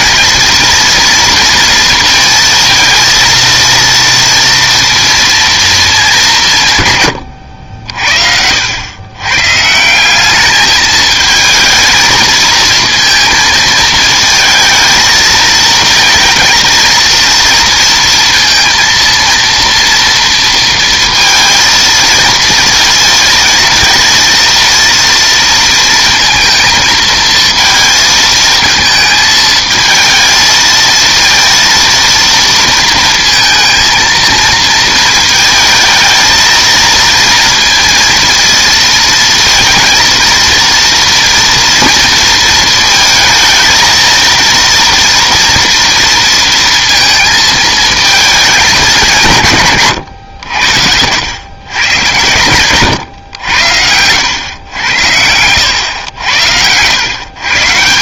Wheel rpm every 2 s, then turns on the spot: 230, 230, 230, 150, 80, 210, 230, 220, 230, 230, 230, 230, 230, 230, 220, 230, 230, 230, 230, 230, 230, 230, 230, 230, 210, 80, 110, 100, 90.
50-52